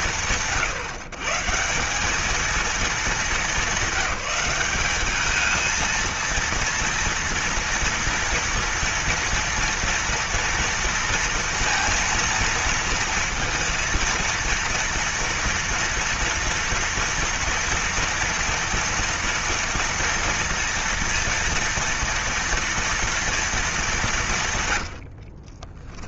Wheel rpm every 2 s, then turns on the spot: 150, 220, 210, 230, 230, 230, 230, 230, 230, 230, 230, 230, 80.
24-26